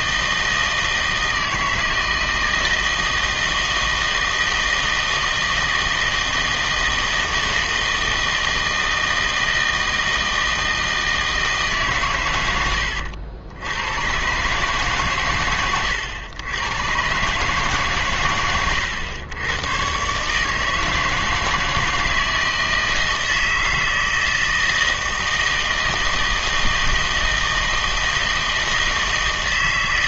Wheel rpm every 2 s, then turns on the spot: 160, 160, 160, 160, 160, 160, 80, 140, 120, 100, 160, 160, 160, 160, 160.
none